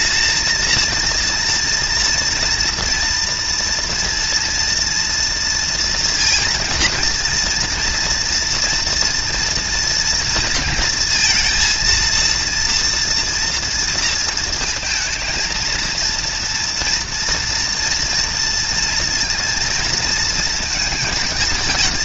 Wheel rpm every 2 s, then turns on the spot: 230, 230, 230, 230, 230, 230, 230, 220, 230, 230, 230.
none